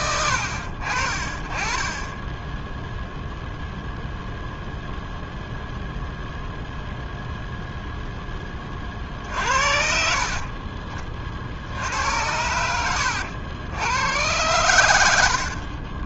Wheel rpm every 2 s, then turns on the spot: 60, 0, 0, 0, 30, 40, 100, 100.
none